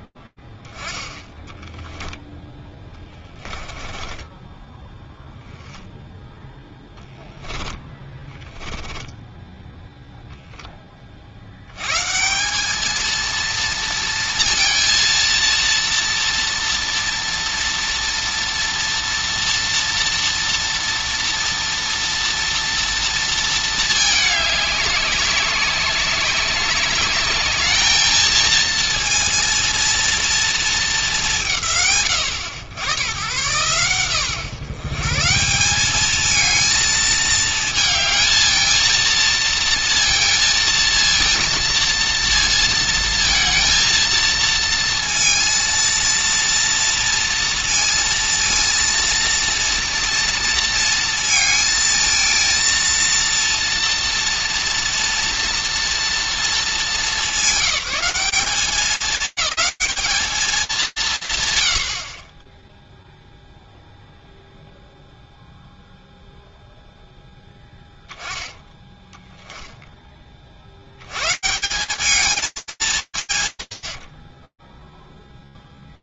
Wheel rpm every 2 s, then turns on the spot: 10, 20, 10, 10, 10, 100, 230, 230, 240, 230, 230, 220, 190, 220, 230, 140, 130, 190, 220, 230, 230, 230, 230, 230, 230, 220, 230, 230, 200, 210, 70, 0, 0, 0, 0, 150, 190, 10.
2-4